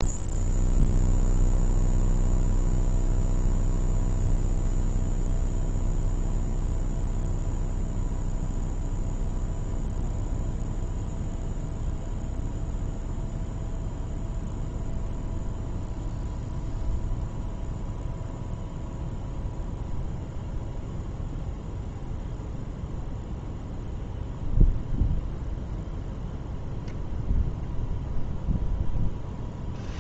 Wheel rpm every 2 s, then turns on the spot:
0, 0, 0, 0, 0, 0, 0, 0, 0, 0, 0, 0, 0, 0, 0.
none